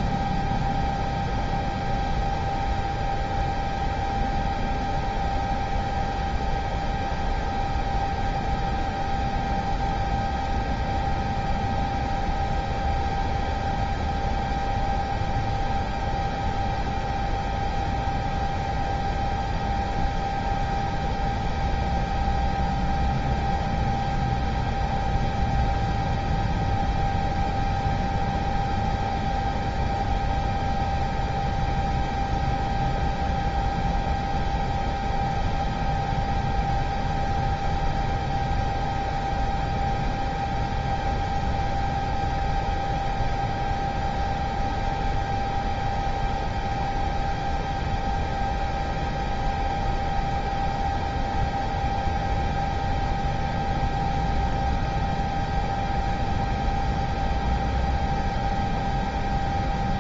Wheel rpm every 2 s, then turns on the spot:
0, 0, 0, 0, 0, 0, 0, 0, 0, 0, 0, 0, 0, 0, 0, 0, 0, 0, 0, 0, 0, 0, 0, 0, 0, 0, 0, 0, 0, 0.
none